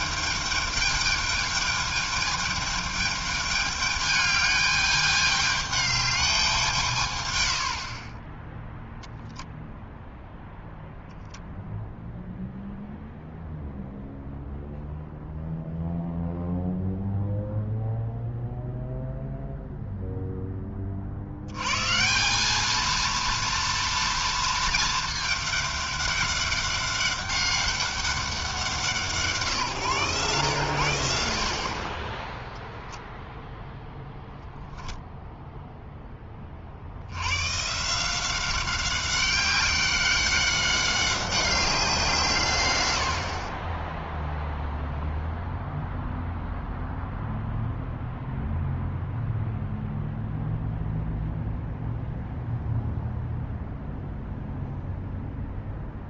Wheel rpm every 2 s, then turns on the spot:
220, 210, 210, 190, 10, 0, 0, 0, 0, 0, 10, 190, 230, 200, 180, 110, 0, 0, 30, 190, 190, 140, 0, 0, 0, 0, 0, 0.
none